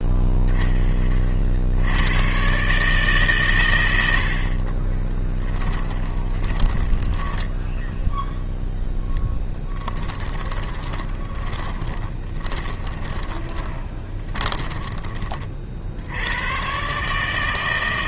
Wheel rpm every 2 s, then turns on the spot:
10, 140, 20, 10, 0, 20, 20, 20, 140.
4-8 10-16